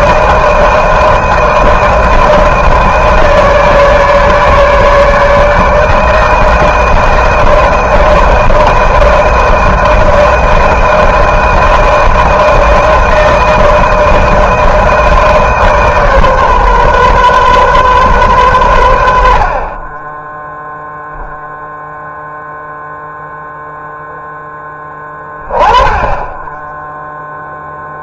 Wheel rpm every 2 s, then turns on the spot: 160, 160, 150, 160, 160, 160, 160, 160, 140, 110, 10, 0, 10, 10.
none